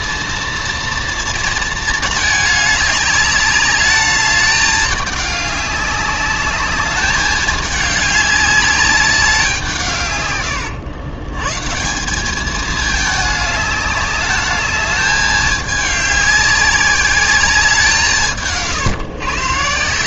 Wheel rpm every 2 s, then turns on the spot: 230, 210, 210, 200, 200, 100, 210, 210, 200, 140.
none